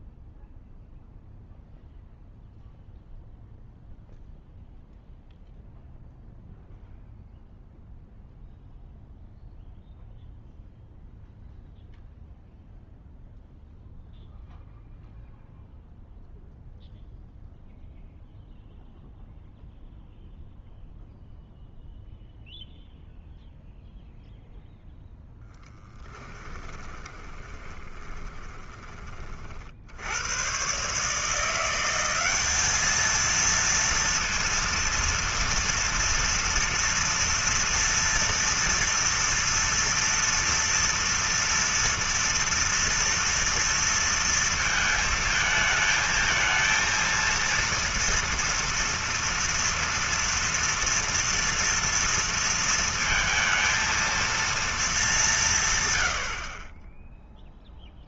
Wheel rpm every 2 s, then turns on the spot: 0, 0, 0, 0, 0, 0, 0, 0, 0, 0, 0, 0, 0, 20, 20, 130, 210, 230, 230, 230, 230, 230, 230, 220, 230, 230, 230, 220, 30.
26-28